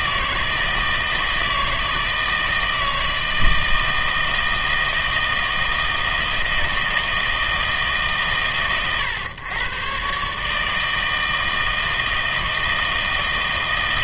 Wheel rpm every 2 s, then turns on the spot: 160, 160, 160, 160, 100, 150, 160.
none